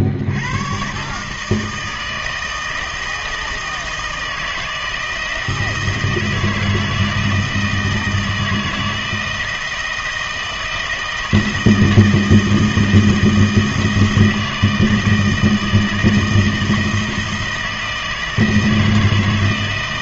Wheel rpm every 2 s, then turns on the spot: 90, 160, 160, 160, 160, 160, 160, 160, 160, 160.
none